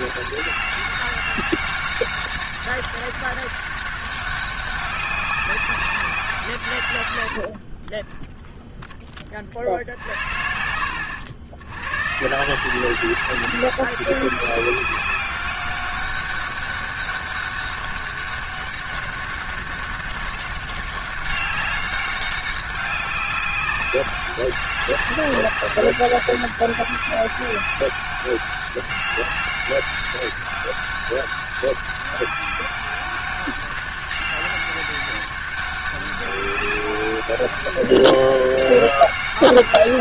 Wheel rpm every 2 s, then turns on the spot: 200, 200, 200, 150, 0, 70, 150, 190, 200, 200, 200, 200, 190, 190, 200, 200, 200, 200, 190, 200.
none